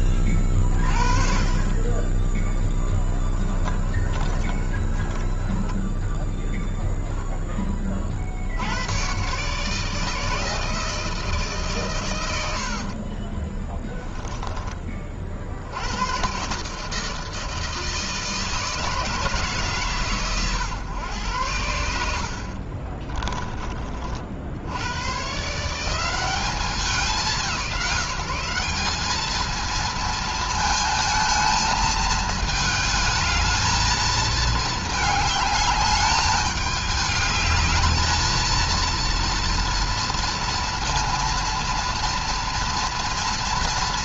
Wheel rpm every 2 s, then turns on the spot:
30, 20, 30, 0, 90, 160, 60, 20, 150, 160, 120, 40, 90, 190, 190, 220, 220, 220, 210, 230, 230, 230.
2-6 22-24